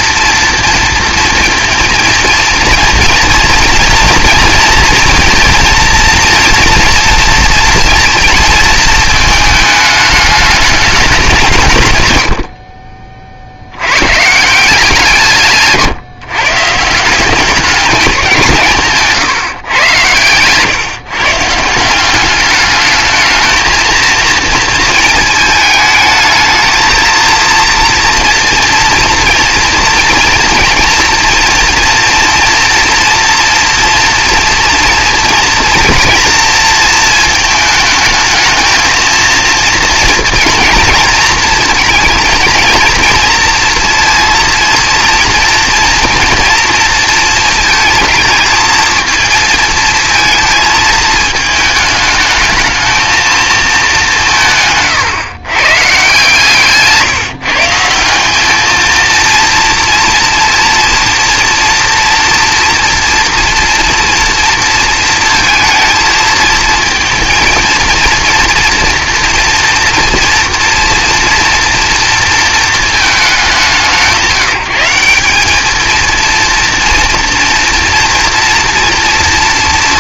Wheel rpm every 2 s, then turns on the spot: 230, 230, 230, 230, 210, 190, 50, 170, 180, 140, 140, 220, 220, 230, 230, 230, 230, 230, 220, 230, 230, 230, 230, 230, 230, 220, 220, 120, 160, 230, 230, 230, 230, 220, 230, 230, 210, 190, 230, 230.
none